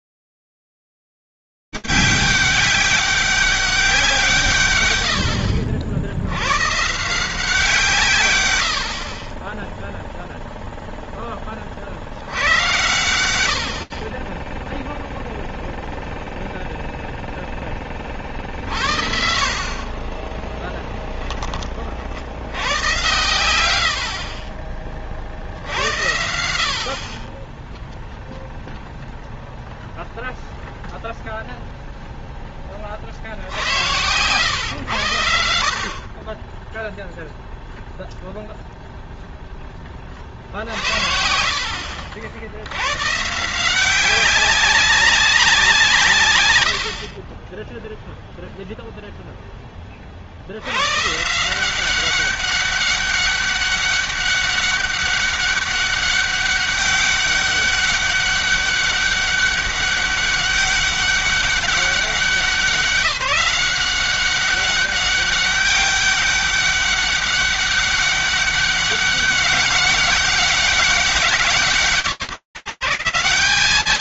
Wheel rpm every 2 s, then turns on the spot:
100, 200, 190, 110, 140, 50, 10, 90, 0, 20, 40, 30, 100, 70, 10, 0, 0, 70, 50, 0, 10, 70, 160, 180, 20, 10, 160, 200, 200, 200, 200, 190, 180, 200, 200, 200, 180.
20-22